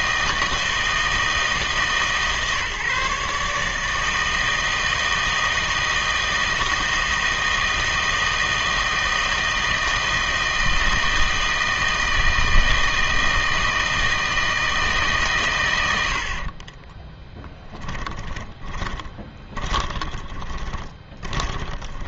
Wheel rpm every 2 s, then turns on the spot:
160, 150, 160, 160, 160, 160, 160, 160, 30, 20, 20.
16-22